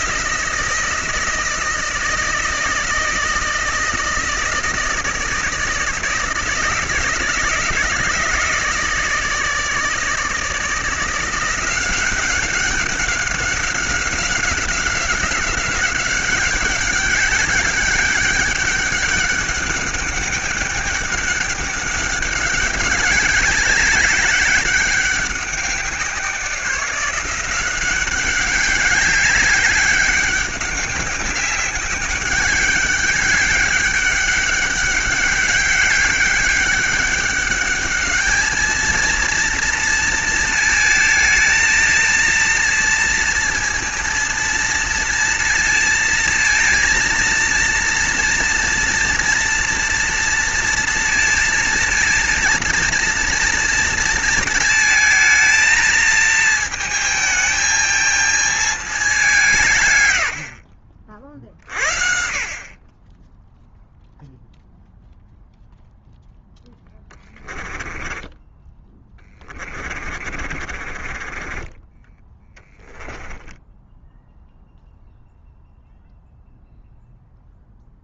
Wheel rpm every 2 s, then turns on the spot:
160, 160, 160, 160, 160, 160, 190, 190, 190, 200, 200, 200, 200, 180, 200, 200, 200, 200, 200, 220, 230, 230, 230, 230, 230, 230, 230, 220, 220, 210, 60, 40, 0, 10, 20, 40, 10, 0, 0.
66-74